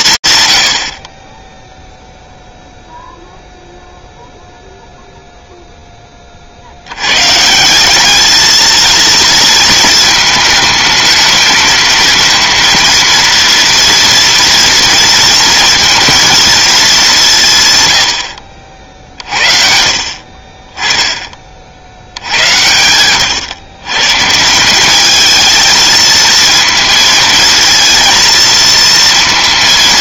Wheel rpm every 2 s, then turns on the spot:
50, 0, 0, 120, 230, 220, 230, 230, 170, 60, 20, 120, 220, 230, 230.
none